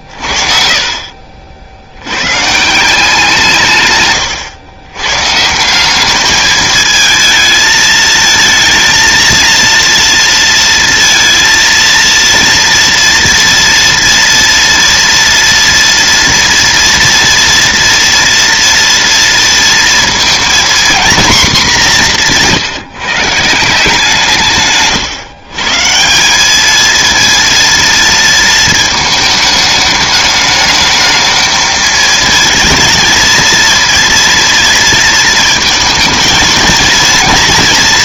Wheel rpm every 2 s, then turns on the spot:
20, 130, 120, 210, 230, 230, 230, 230, 230, 230, 230, 170, 160, 210, 230, 210, 230, 230, 230.
none